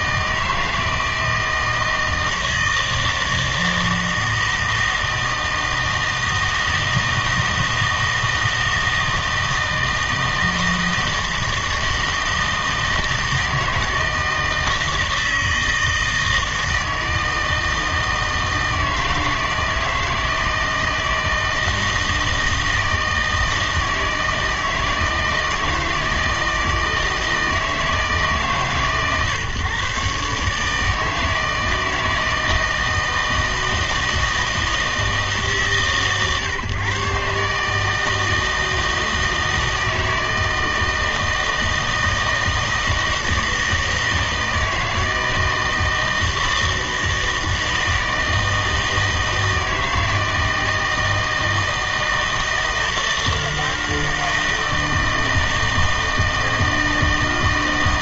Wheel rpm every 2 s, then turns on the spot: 160, 160, 160, 160, 160, 160, 160, 160, 160, 160, 160, 160, 160, 160, 140, 150, 160, 160, 140, 160, 160, 160, 160, 160, 160, 160, 160, 160, 160.
none